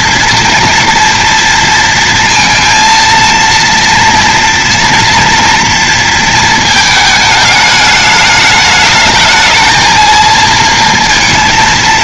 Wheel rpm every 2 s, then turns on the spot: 230, 230, 230, 230, 210, 220.
none